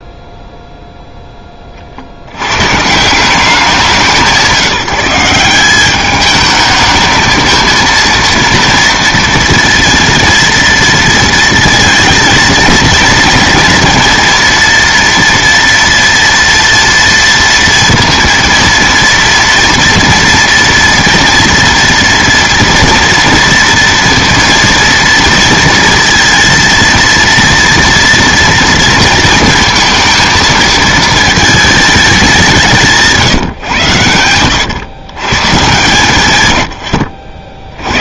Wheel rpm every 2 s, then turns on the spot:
0, 120, 170, 220, 230, 230, 230, 230, 230, 230, 230, 230, 230, 230, 230, 230, 170, 100, 120.
none